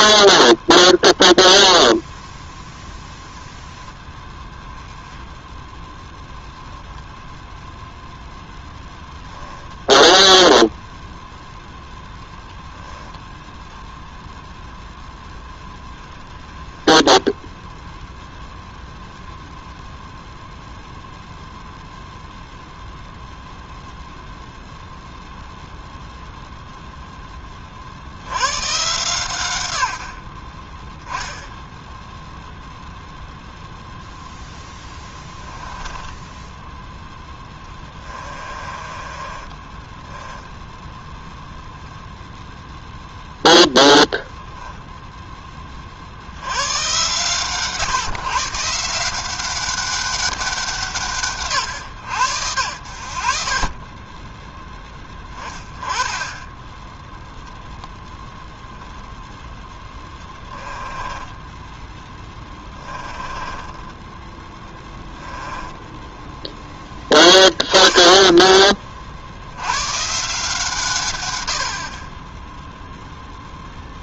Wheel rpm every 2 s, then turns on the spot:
0, 0, 10, 0, 0, 0, 0, 0, 10, 0, 0, 0, 0, 0, 140, 20, 0, 10, 10, 30, 0, 0, 10, 110, 160, 170, 80, 10, 10, 0, 20, 10, 10, 10, 30, 140, 0.
34-36 38-40 60-66